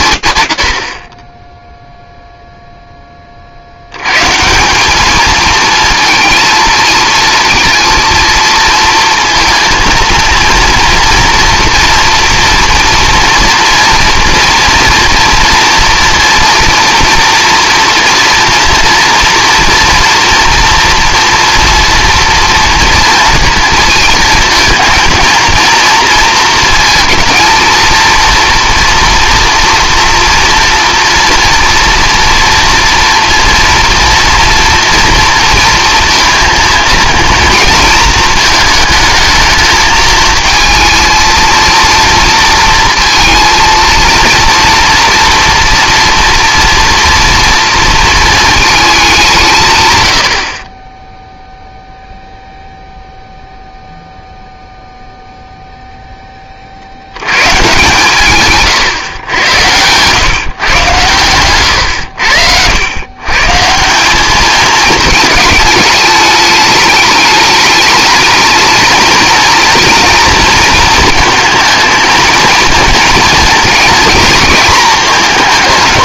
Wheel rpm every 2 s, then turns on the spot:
60, 10, 190, 230, 230, 230, 230, 230, 230, 230, 230, 230, 230, 220, 240, 230, 230, 240, 230, 220, 230, 230, 230, 230, 210, 20, 0, 0, 40, 140, 130, 100, 210, 210, 230, 240, 230, 220.
none